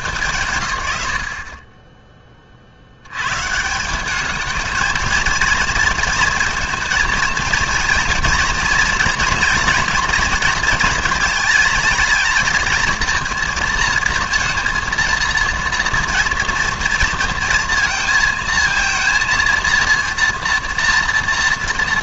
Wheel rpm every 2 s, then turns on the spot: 110, 90, 220, 230, 230, 220, 220, 230, 230, 230, 230.
none